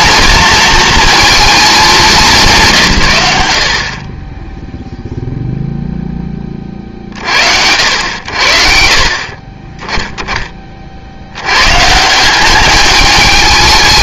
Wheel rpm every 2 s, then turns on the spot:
230, 170, 0, 40, 60, 40, 210.
none